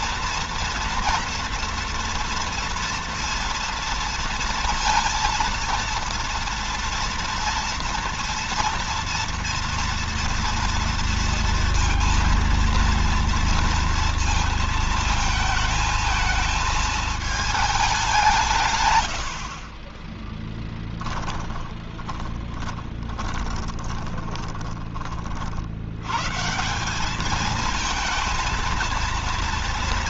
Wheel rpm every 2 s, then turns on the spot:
240, 230, 230, 230, 240, 240, 230, 230, 220, 130, 10, 20, 20, 160, 230.
22-24